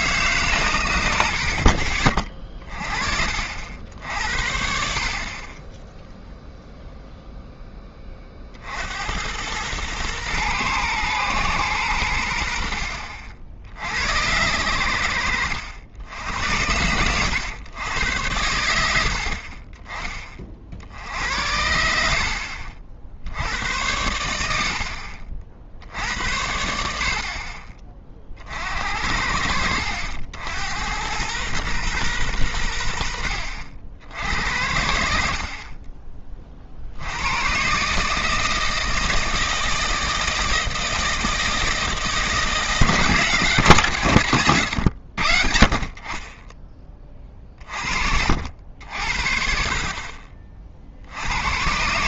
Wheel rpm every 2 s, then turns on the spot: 120, 30, 60, 0, 50, 120, 70, 100, 80, 80, 50, 40, 80, 80, 50, 80, 90, 70, 40, 160, 160, 170, 110, 20, 60, 30.
none